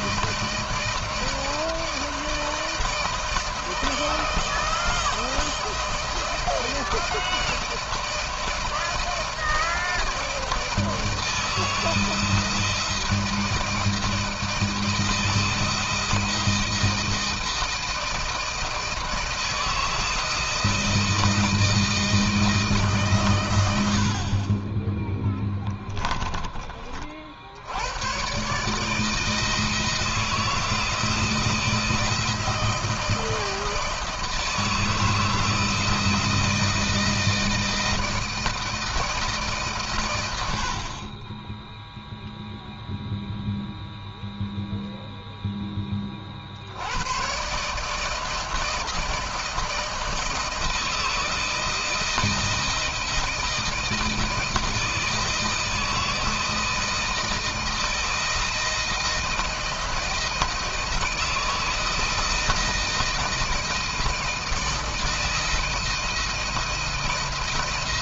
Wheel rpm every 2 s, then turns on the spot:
160, 160, 160, 170, 160, 160, 160, 160, 160, 160, 160, 150, 30, 30, 140, 160, 160, 160, 170, 160, 80, 0, 0, 60, 160, 160, 160, 160, 160, 160, 160, 160, 160, 160.
none